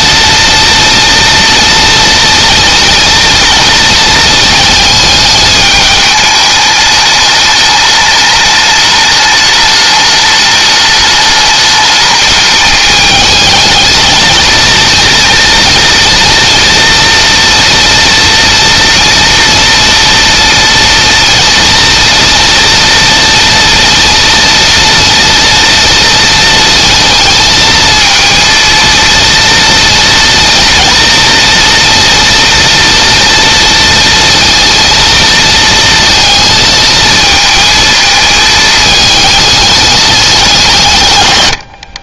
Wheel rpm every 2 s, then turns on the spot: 230, 230, 220, 210, 210, 210, 210, 230, 230, 230, 240, 230, 230, 230, 230, 230, 230, 230, 220, 220, 140.
none